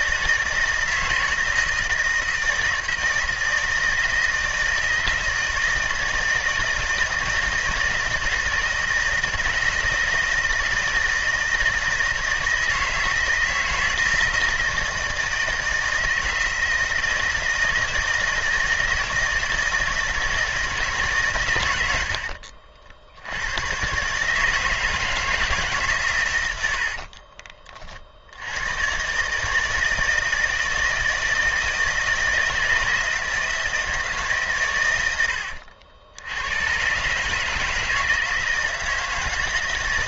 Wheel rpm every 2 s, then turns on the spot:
160, 160, 160, 160, 160, 160, 160, 160, 160, 160, 140, 70, 160, 60, 120, 160, 160, 100, 130, 160.
26-28